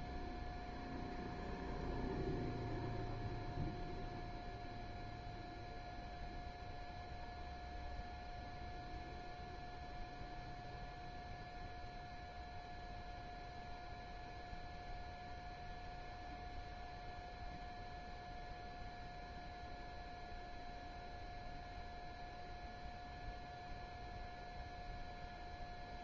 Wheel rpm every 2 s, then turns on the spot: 0, 0, 0, 0, 0, 0, 0, 0, 0, 0, 0, 0, 0.
none